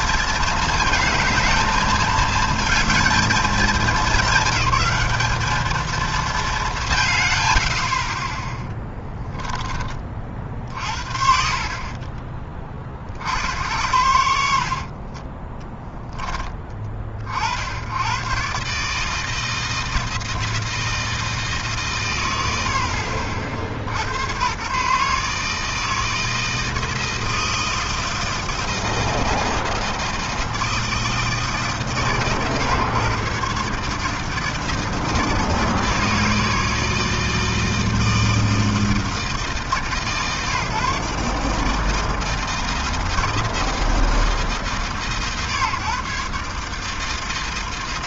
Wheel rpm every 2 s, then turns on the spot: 220, 210, 210, 100, 10, 20, 70, 20, 80, 160, 150, 80, 150, 160, 160, 150, 140, 160, 160, 160, 150, 160, 140, 160.
14-16